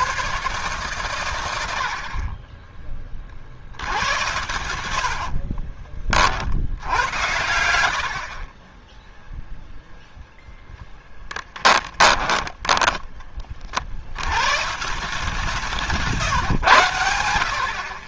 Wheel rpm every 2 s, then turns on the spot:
120, 20, 80, 80, 20, 0, 10, 140, 110.
4-10 12-14